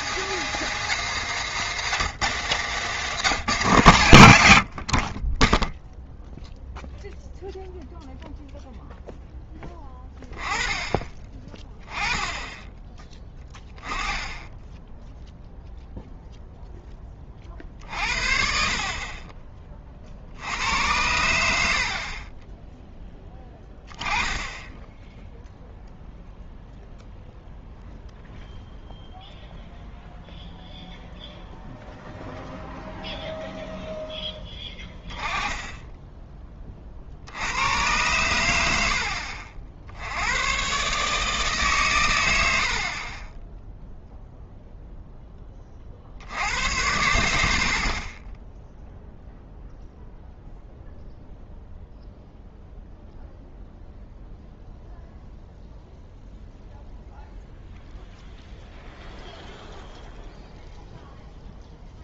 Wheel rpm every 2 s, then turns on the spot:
200, 180, 70, 0, 0, 20, 10, 10, 0, 50, 80, 10, 10, 0, 0, 0, 0, 10, 30, 90, 120, 60, 0, 70, 0, 0, 0, 0, 0, 0, 0.
none